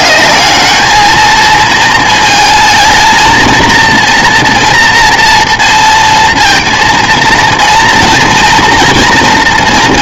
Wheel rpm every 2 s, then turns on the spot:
210, 230, 230, 230, 230.
none